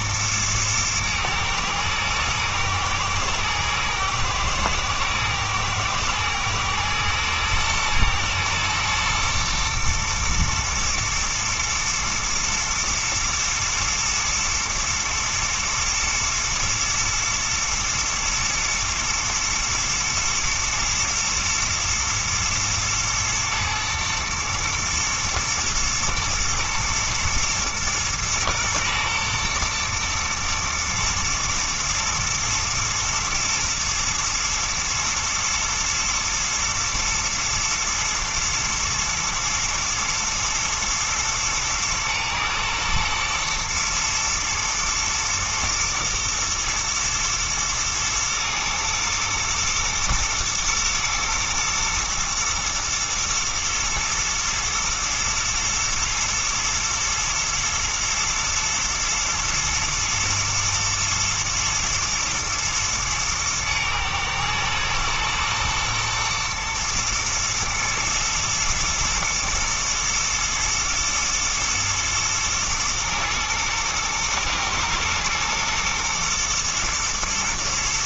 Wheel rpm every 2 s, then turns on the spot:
110, 110, 120, 110, 110, 110, 110, 120, 110, 110, 120, 120, 110, 110, 110, 110, 120, 120, 120, 110, 120, 120, 120, 120, 110, 110, 120, 110, 110, 110, 120, 110, 120, 120, 120, 120, 110, 120, 120.
none